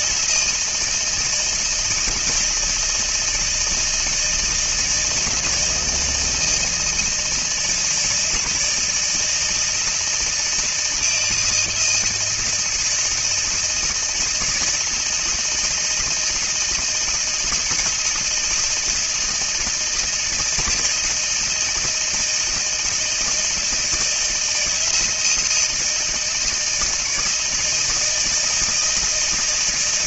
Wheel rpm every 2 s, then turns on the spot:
160, 160, 160, 160, 160, 160, 160, 160, 160, 160, 160, 160, 160, 160, 160.
none